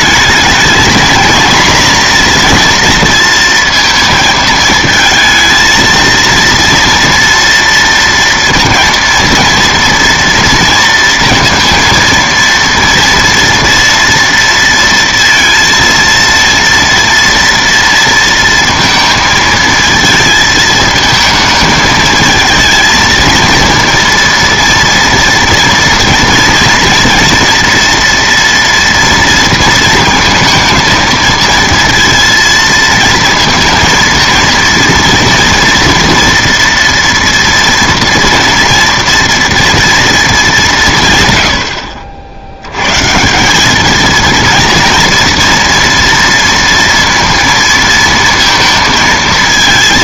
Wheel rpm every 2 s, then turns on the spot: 230, 230, 220, 230, 230, 230, 230, 230, 230, 230, 220, 230, 230, 230, 230, 230, 230, 230, 230, 230, 180, 100, 230, 230, 230.
none